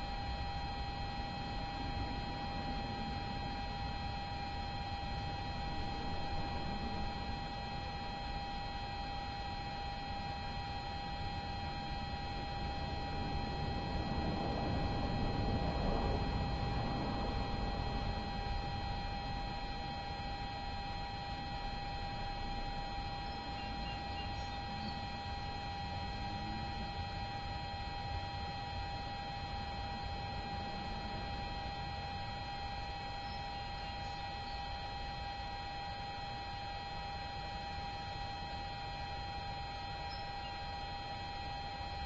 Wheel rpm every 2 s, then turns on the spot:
0, 0, 0, 0, 0, 0, 0, 0, 0, 0, 0, 0, 0, 0, 0, 0, 0, 0, 0, 0, 0.
none